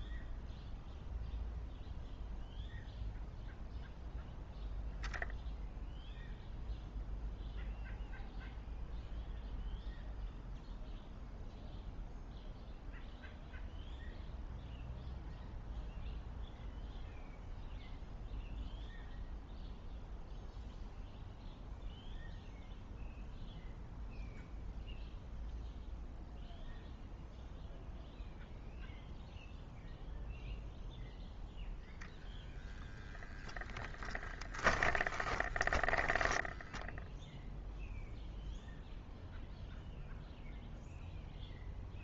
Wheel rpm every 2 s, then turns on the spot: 0, 0, 0, 0, 0, 0, 0, 0, 0, 0, 0, 0, 0, 0, 0, 0, 0, 20, 10, 0, 0.
34-36